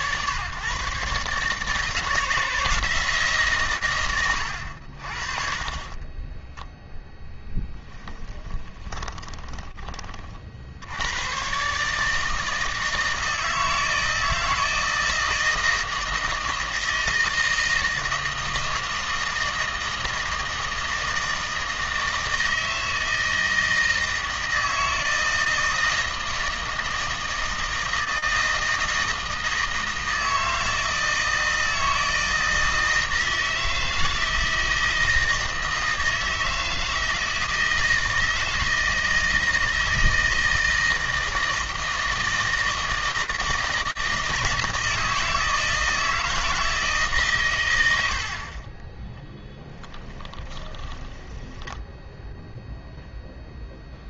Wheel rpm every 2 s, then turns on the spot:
130, 160, 70, 10, 20, 80, 160, 160, 160, 160, 160, 160, 160, 160, 160, 160, 160, 160, 160, 160, 160, 160, 160, 150, 20, 20, 0.
8-10 50-52